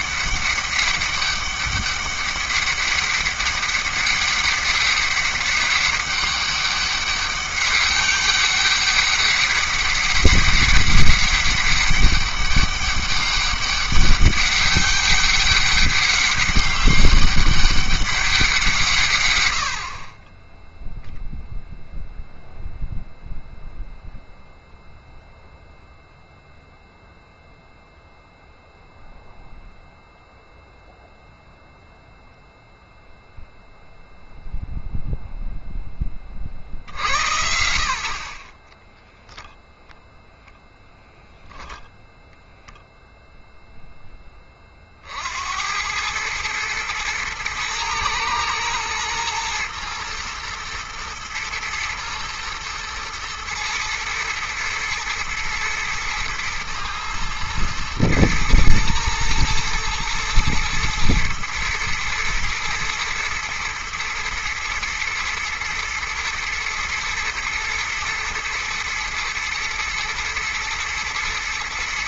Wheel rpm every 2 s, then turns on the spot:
200, 200, 200, 200, 200, 200, 190, 200, 200, 170, 0, 0, 0, 0, 0, 0, 0, 0, 60, 20, 0, 0, 50, 110, 120, 120, 110, 110, 120, 120, 110, 110, 120, 110, 120, 120.
38-40